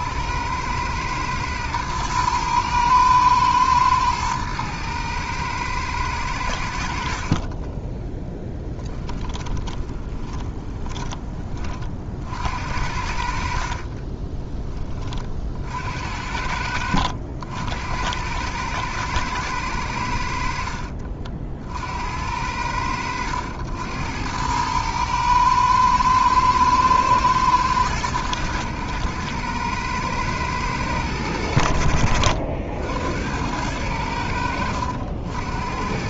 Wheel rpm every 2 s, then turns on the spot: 100, 110, 110, 80, 10, 20, 60, 20, 70, 110, 60, 80, 100, 120, 110, 110, 70, 70.
8-12